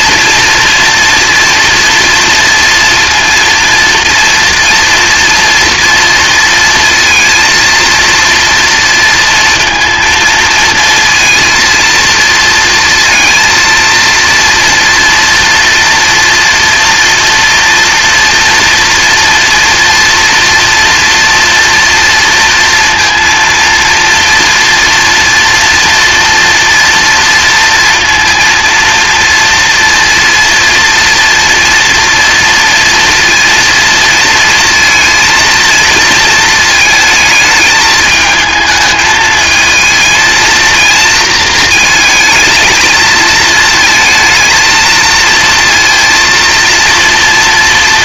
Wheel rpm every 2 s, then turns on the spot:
230, 230, 230, 230, 230, 230, 230, 230, 230, 230, 230, 230, 240, 230, 230, 230, 230, 230, 220, 220, 230, 220, 220, 230.
none